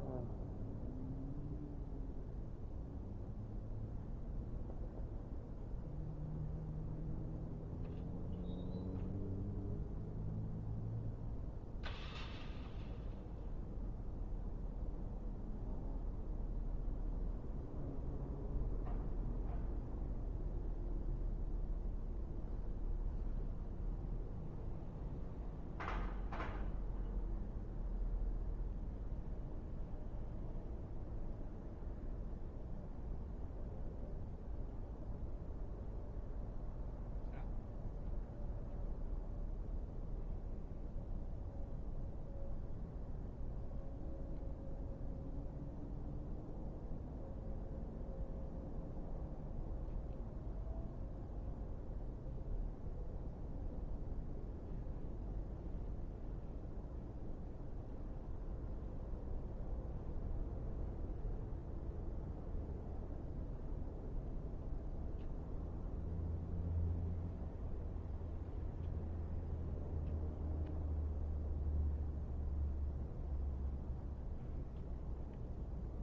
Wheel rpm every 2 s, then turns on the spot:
0, 0, 0, 0, 0, 0, 0, 0, 0, 0, 0, 0, 0, 0, 0, 0, 0, 0, 0, 0, 0, 0, 0, 0, 0, 0, 0, 0, 0, 0, 0, 0, 0, 0, 0, 0, 0, 0.
none